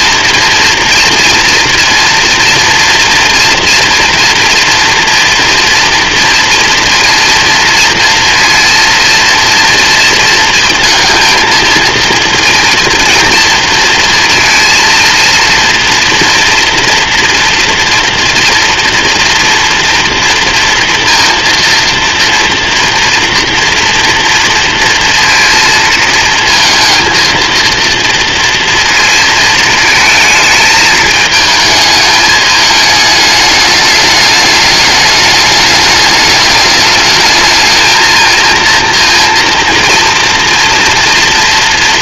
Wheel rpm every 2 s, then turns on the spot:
230, 240, 230, 230, 230, 230, 230, 230, 230, 230, 230, 230, 230, 230, 230, 220, 210, 210, 210, 230, 240.
none